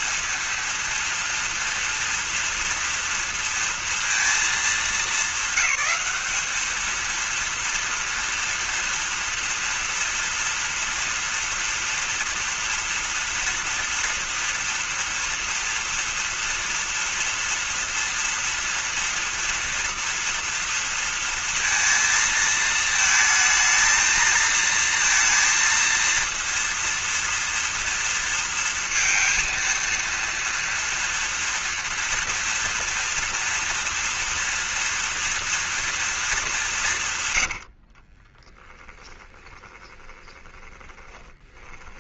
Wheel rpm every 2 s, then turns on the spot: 230, 230, 220, 220, 230, 240, 230, 230, 240, 230, 230, 220, 230, 230, 230, 230, 230, 230, 200, 30, 20.
38-42